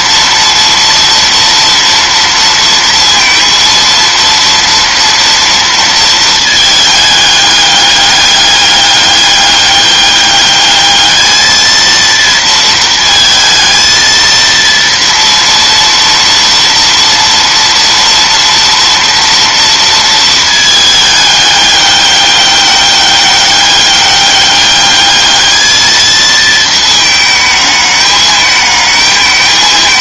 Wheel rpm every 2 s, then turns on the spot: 230, 230, 230, 220, 200, 210, 230, 230, 230, 230, 220, 200, 200, 220, 210.
none